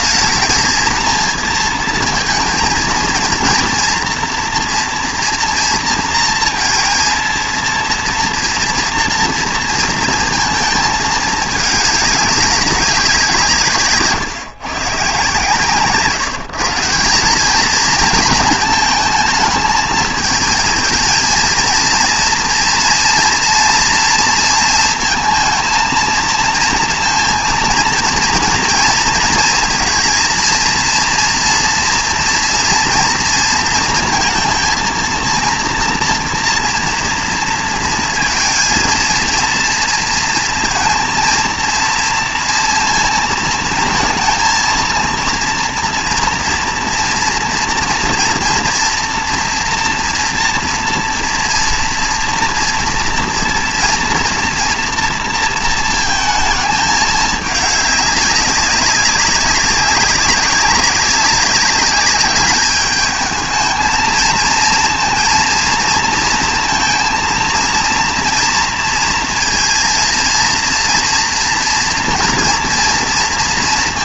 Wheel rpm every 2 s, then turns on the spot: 220, 230, 230, 230, 230, 220, 200, 140, 170, 220, 220, 230, 230, 230, 230, 230, 240, 230, 230, 230, 230, 230, 230, 240, 230, 230, 230, 230, 220, 200, 200, 210, 220, 230, 230, 230, 230.
none